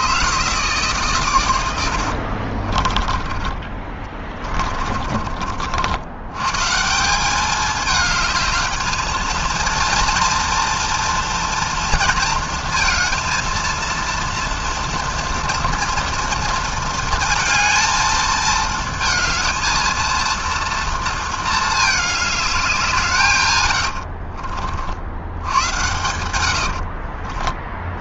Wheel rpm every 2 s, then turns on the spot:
150, 40, 30, 140, 220, 230, 230, 230, 230, 220, 230, 210, 50, 80.
2-6 26-28